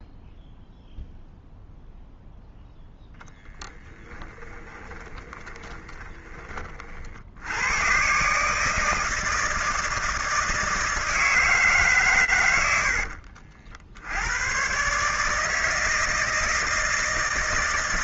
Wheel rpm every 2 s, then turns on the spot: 0, 0, 20, 40, 160, 160, 60, 140, 170.
4-6